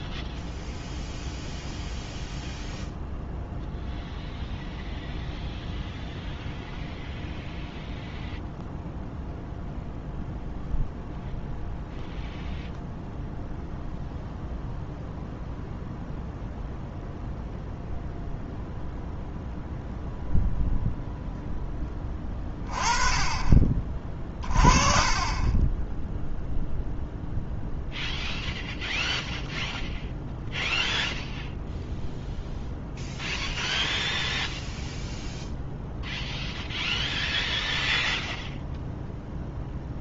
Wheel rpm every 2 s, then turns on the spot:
0, 0, 0, 0, 0, 0, 0, 0, 0, 0, 0, 20, 30, 0, 0, 0, 0, 0, 0, 0.
24-26